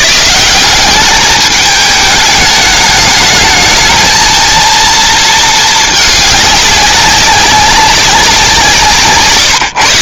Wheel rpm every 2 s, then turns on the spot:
180, 210, 230, 200, 170.
none